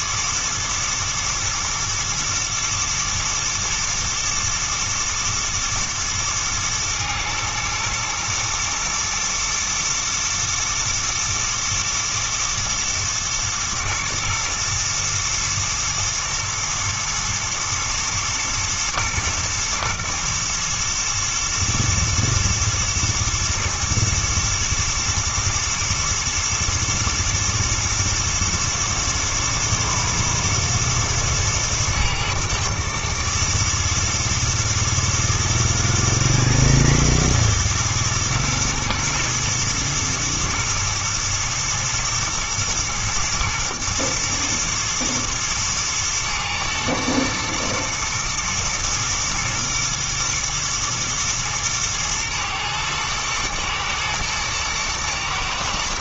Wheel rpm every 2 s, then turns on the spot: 110, 120, 110, 110, 110, 110, 120, 120, 120, 120, 110, 110, 110, 110, 110, 120, 110, 110, 110, 120, 110, 120, 120, 110, 110, 120, 110, 110.
none